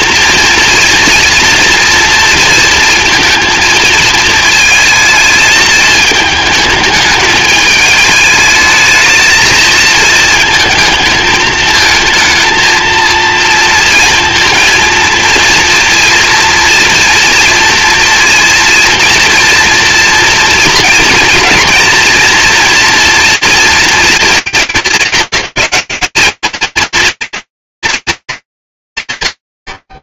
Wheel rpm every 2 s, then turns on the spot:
230, 230, 220, 220, 210, 230, 230, 230, 230, 230, 230, 230, 200, 210, 210.
none